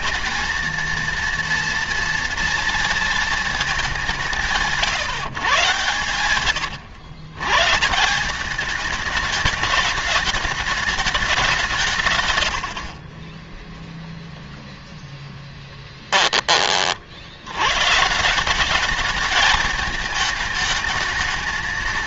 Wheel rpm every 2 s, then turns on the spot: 230, 230, 170, 110, 210, 210, 60, 0, 50, 200, 230.
none